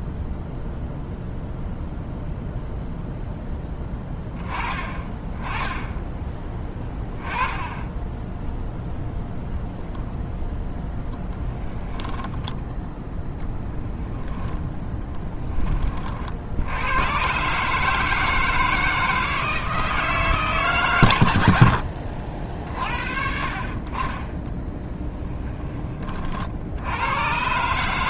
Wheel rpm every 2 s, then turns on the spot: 0, 0, 30, 10, 0, 10, 0, 10, 100, 160, 130, 50, 20, 90.
10-12 14-16 24-26